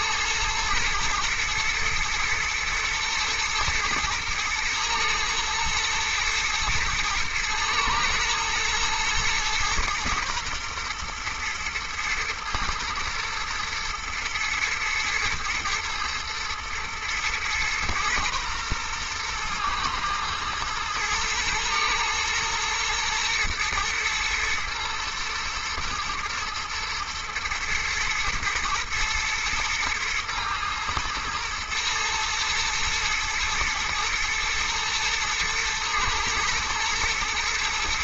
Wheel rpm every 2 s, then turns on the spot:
120, 110, 110, 110, 120, 120, 120, 110, 120, 120, 110, 120, 110, 110, 110, 110, 110, 120, 110.
none